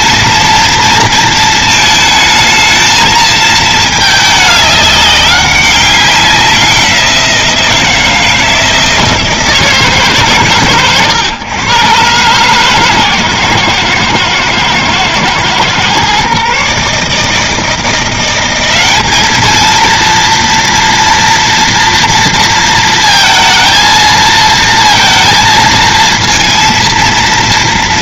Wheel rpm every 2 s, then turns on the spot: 230, 220, 200, 180, 160, 110, 130, 110, 150, 200, 230, 230, 230, 230.
none